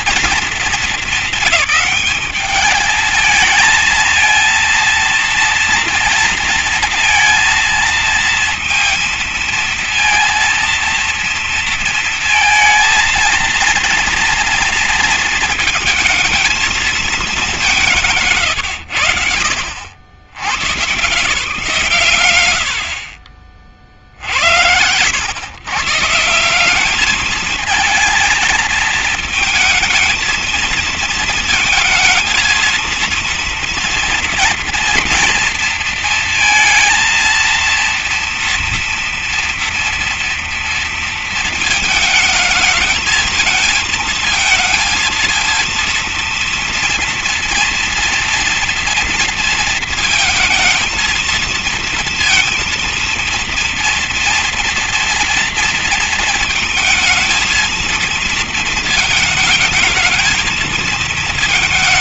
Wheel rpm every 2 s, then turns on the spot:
230, 210, 230, 230, 230, 230, 220, 230, 220, 140, 110, 100, 80, 190, 220, 230, 220, 240, 230, 230, 230, 220, 220, 230, 230, 220, 220, 230, 220, 220, 220.
none